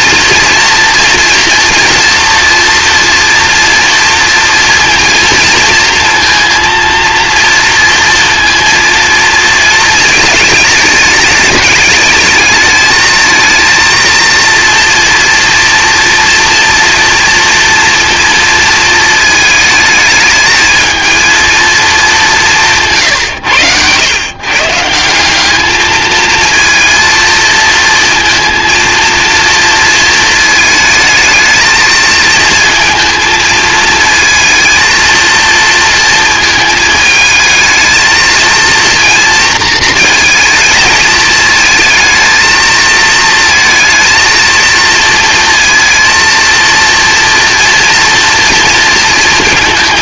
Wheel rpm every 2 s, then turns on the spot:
230, 230, 230, 230, 230, 220, 220, 230, 230, 220, 220, 160, 150, 230, 230, 220, 220, 230, 220, 230, 220, 220, 230, 230, 230.
none